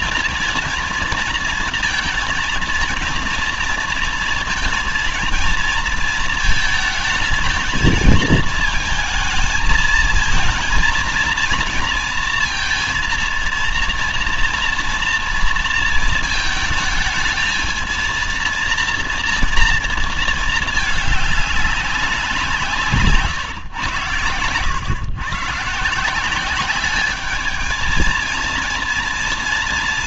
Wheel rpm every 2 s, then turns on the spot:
240, 230, 230, 220, 220, 220, 230, 230, 220, 230, 220, 180, 100, 200, 230.
none